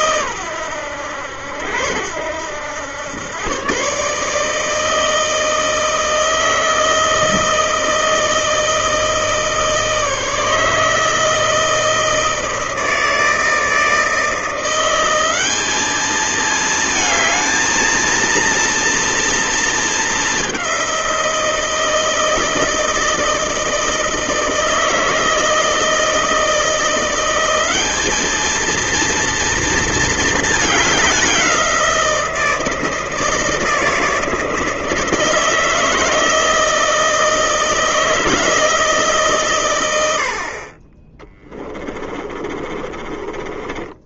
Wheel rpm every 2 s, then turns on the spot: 100, 100, 160, 160, 160, 160, 160, 180, 220, 230, 190, 160, 160, 170, 220, 210, 160, 160, 160, 160, 30, 20.
42-44